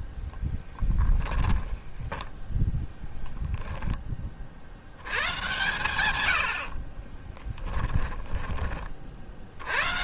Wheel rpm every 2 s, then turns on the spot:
10, 0, 70, 40, 30.
0-2 6-8